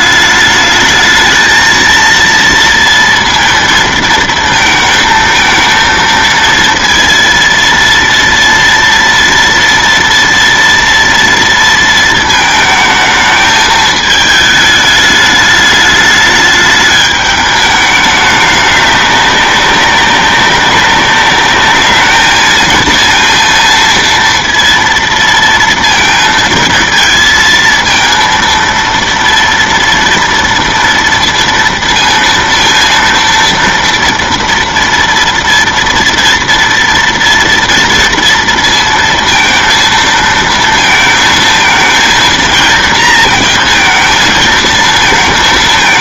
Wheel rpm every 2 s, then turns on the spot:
210, 230, 230, 230, 240, 230, 220, 210, 210, 200, 200, 230, 230, 220, 230, 230, 230, 230, 230, 230, 230, 230, 220.
none